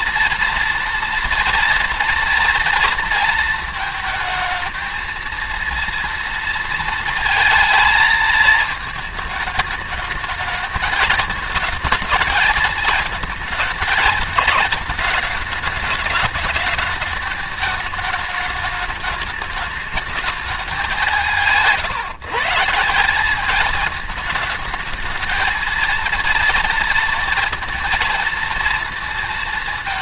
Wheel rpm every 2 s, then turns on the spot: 230, 230, 220, 230, 220, 220, 220, 220, 210, 210, 200, 160, 210, 230, 230.
none